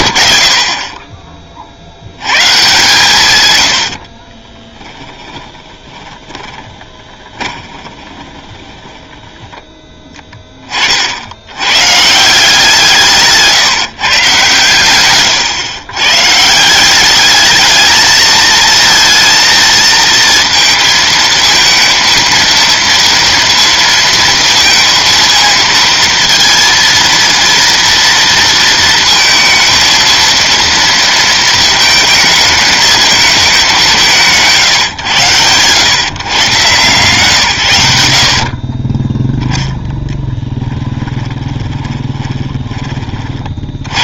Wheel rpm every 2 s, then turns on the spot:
60, 140, 20, 20, 30, 30, 170, 130, 180, 220, 230, 230, 230, 230, 230, 230, 220, 150, 140, 20, 10, 20.
4-10 40-42